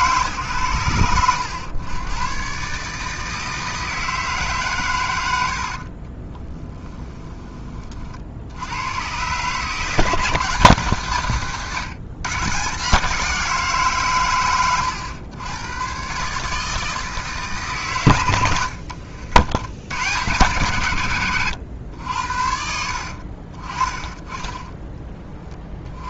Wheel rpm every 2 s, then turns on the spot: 120, 130, 140, 20, 70, 160, 140, 110, 150, 90, 120, 70, 10.
6-8 24-26